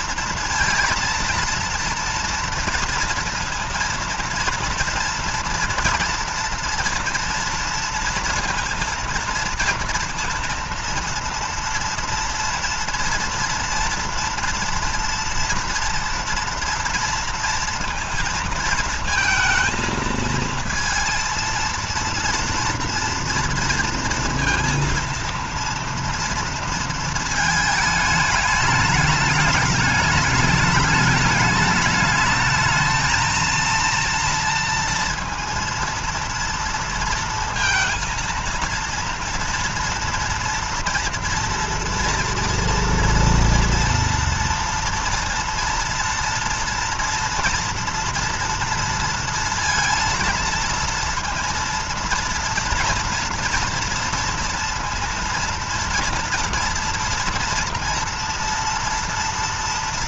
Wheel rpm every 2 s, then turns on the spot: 230, 230, 230, 230, 230, 230, 230, 230, 230, 230, 230, 230, 230, 230, 210, 210, 220, 230, 230, 230, 230, 230, 230, 240, 230, 230, 230, 230, 240, 230.
none